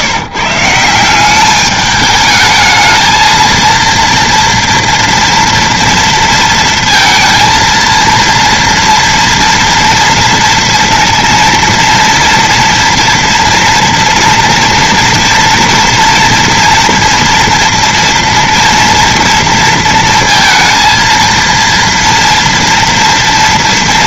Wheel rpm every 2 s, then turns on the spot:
150, 210, 230, 230, 230, 230, 230, 240, 230, 230, 230, 230.
none